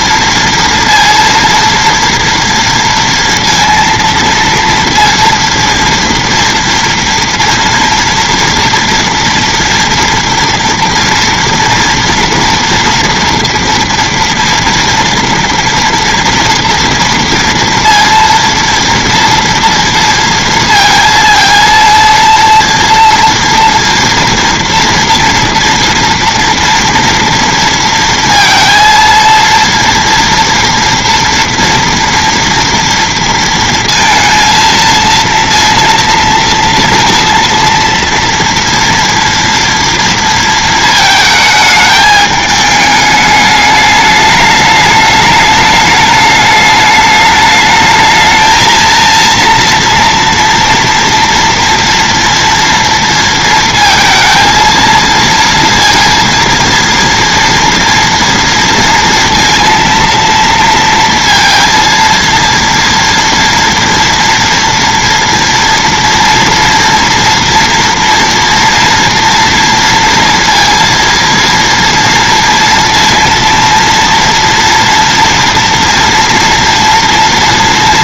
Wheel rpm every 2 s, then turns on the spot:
230, 230, 230, 230, 230, 230, 230, 230, 230, 230, 230, 230, 230, 230, 230, 230, 230, 230, 230, 230, 220, 210, 210, 210, 230, 230, 230, 230, 230, 230, 230, 230, 230, 240, 230, 230, 230, 230, 230.
none